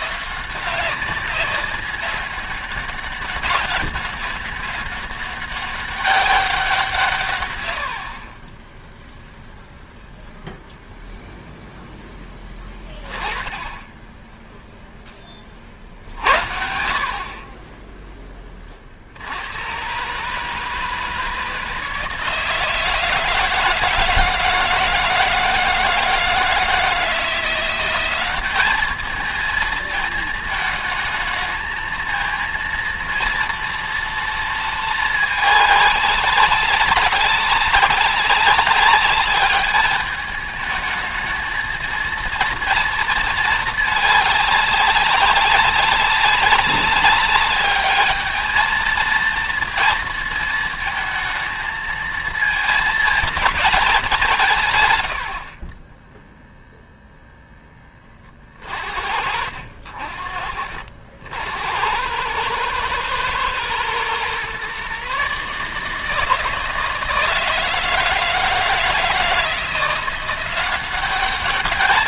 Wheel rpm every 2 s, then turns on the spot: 170, 200, 200, 180, 20, 0, 10, 0, 60, 30, 150, 160, 160, 170, 200, 220, 230, 220, 200, 200, 220, 230, 200, 190, 220, 220, 220, 140, 0, 40, 50, 110, 130, 160, 160, 180.
8-10 12-14 54-56